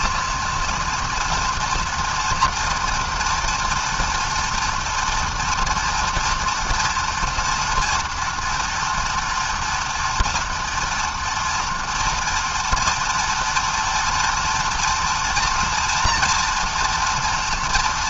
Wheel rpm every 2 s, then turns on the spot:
230, 230, 240, 230, 230, 240, 230, 230, 230.
none